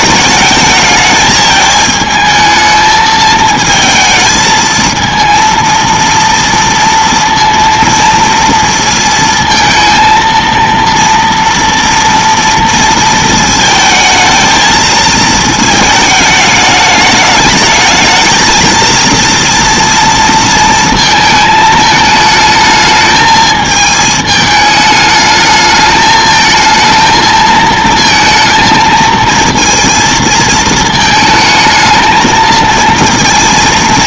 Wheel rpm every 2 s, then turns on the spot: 220, 220, 220, 230, 230, 230, 230, 220, 210, 220, 230, 220, 210, 220, 230, 230, 230.
none